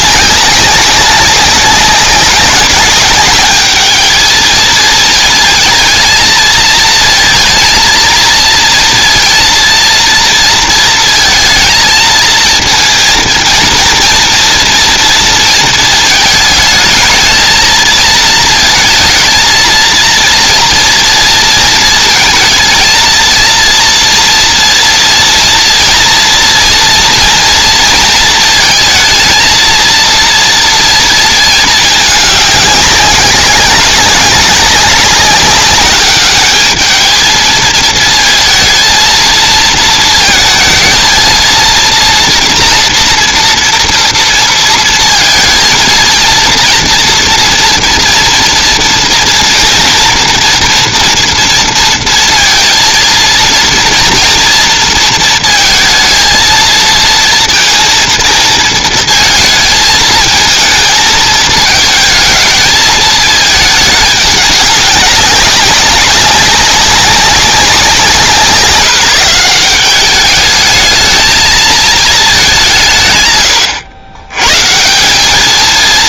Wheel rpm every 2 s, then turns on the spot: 200, 200, 220, 220, 230, 230, 230, 230, 220, 230, 230, 230, 240, 230, 230, 230, 200, 190, 220, 220, 230, 230, 230, 230, 230, 230, 230, 230, 230, 230, 220, 220, 200, 200, 160, 210, 170, 140.
none